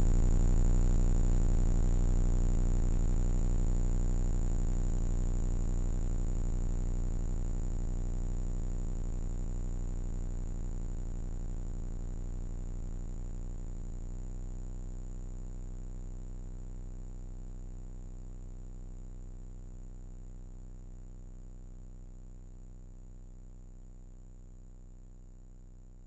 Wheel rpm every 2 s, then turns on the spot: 0, 60, 120, 50, 30, 0, 0, 0, 0, 0, 0, 0, 0.
none